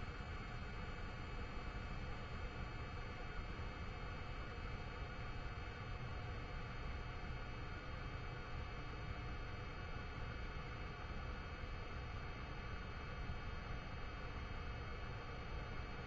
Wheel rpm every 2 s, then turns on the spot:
0, 0, 0, 0, 0, 0, 0, 0.
none